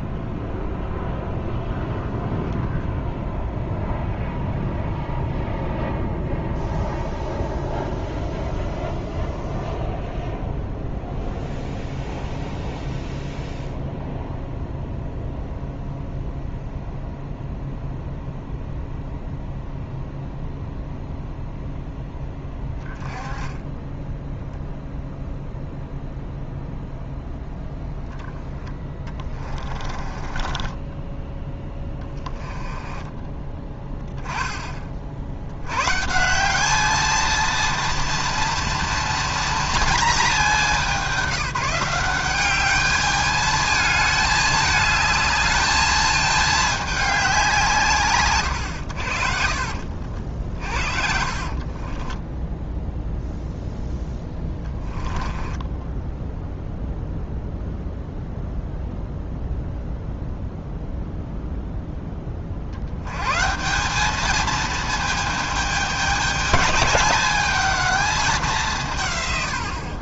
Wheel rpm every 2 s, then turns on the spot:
0, 0, 0, 0, 0, 0, 0, 0, 0, 0, 0, 10, 0, 0, 10, 20, 20, 30, 210, 230, 210, 210, 220, 220, 120, 40, 0, 10, 0, 0, 0, 60, 220, 210, 180.
28-34 50-52 54-56